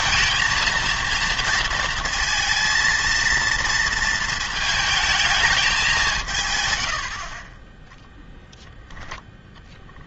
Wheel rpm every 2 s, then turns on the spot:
230, 230, 220, 110, 0.
none